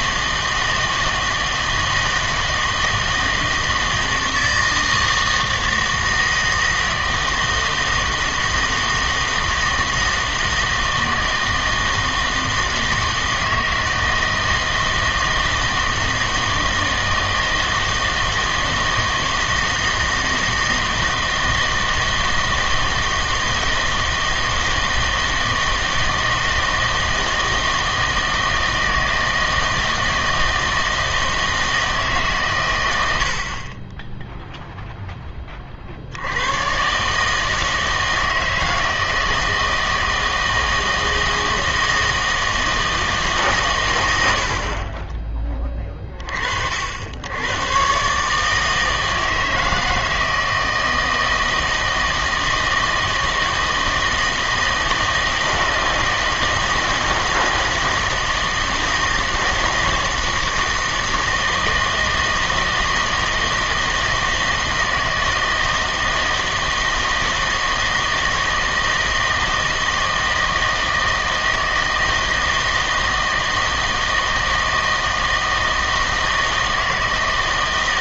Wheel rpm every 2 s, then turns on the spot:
160, 160, 160, 160, 160, 160, 160, 160, 160, 160, 160, 160, 160, 160, 160, 160, 110, 0, 120, 160, 160, 160, 50, 70, 160, 160, 160, 160, 160, 160, 160, 160, 160, 160, 160, 160, 160, 160, 160.
none